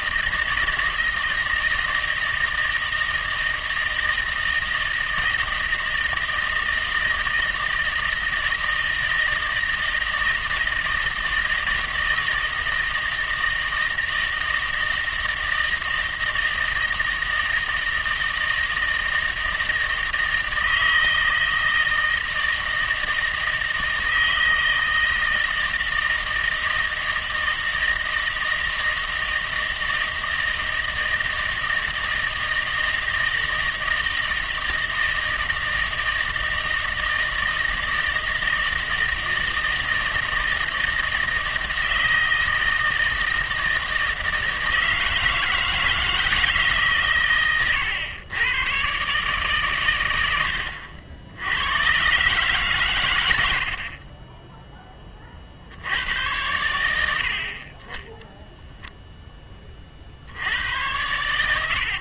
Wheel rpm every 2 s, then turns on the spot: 160, 160, 160, 160, 160, 160, 160, 160, 160, 160, 160, 160, 160, 160, 160, 160, 160, 160, 160, 160, 160, 160, 160, 150, 120, 80, 130, 10, 100, 0, 100.
none